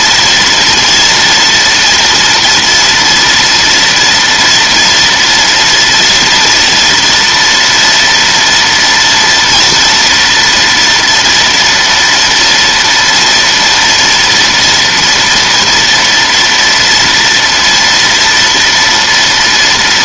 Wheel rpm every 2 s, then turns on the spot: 240, 230, 230, 230, 230, 230, 230, 240, 230, 230.
none